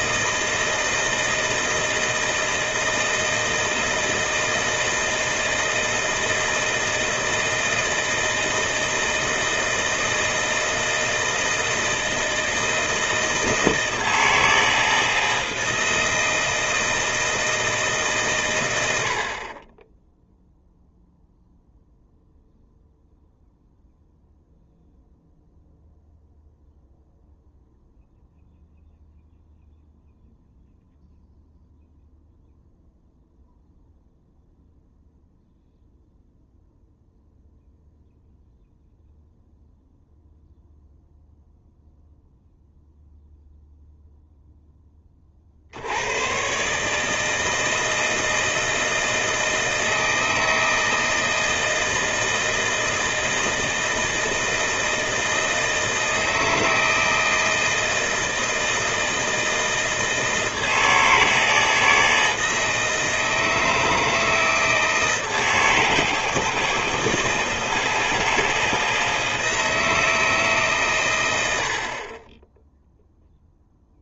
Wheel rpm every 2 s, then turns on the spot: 160, 160, 160, 160, 160, 160, 160, 160, 160, 100, 0, 0, 0, 0, 0, 0, 0, 0, 0, 0, 0, 0, 10, 140, 160, 160, 160, 160, 160, 160, 160, 160, 160, 160, 160, 140, 10.
none